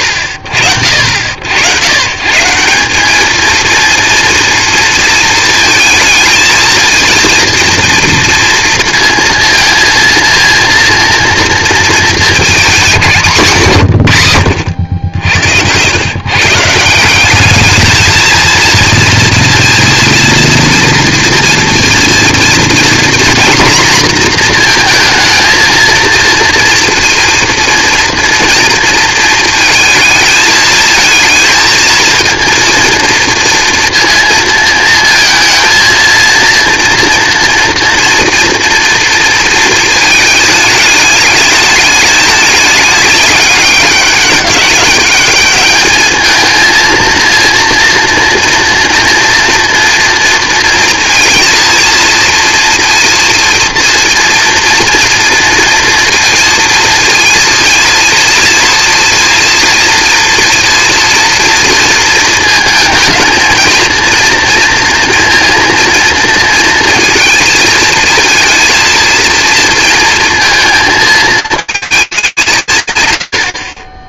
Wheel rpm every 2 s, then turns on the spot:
50, 170, 240, 230, 230, 230, 210, 100, 160, 230, 230, 230, 230, 230, 230, 220, 230, 230, 230, 230, 220, 210, 200, 230, 230, 230, 230, 230, 230, 230, 230, 220, 230, 230, 230, 230, 150.
none